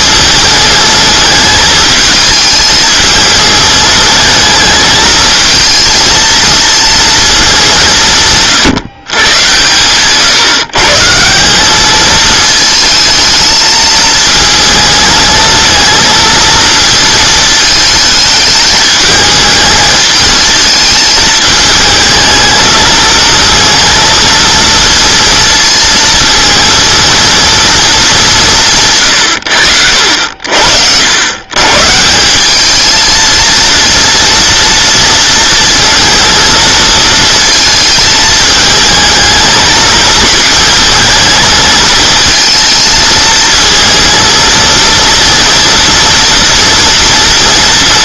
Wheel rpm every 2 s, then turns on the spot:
220, 220, 220, 230, 150, 150, 220, 220, 230, 210, 220, 220, 230, 230, 150, 70, 210, 230, 230, 220, 230, 230, 230, 230.
none